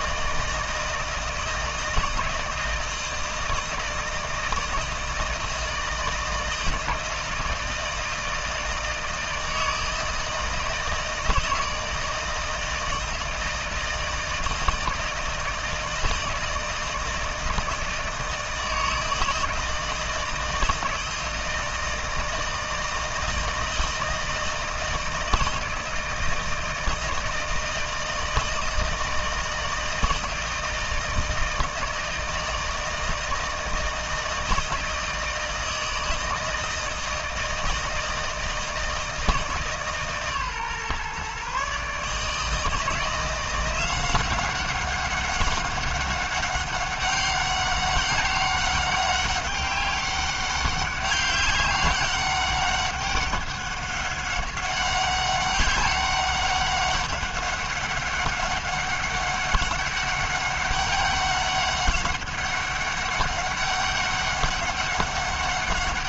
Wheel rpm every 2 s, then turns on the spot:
160, 160, 160, 160, 160, 160, 160, 160, 160, 160, 160, 160, 160, 160, 160, 160, 160, 160, 160, 160, 140, 160, 190, 200, 200, 190, 200, 190, 200, 200, 200, 190, 200.
none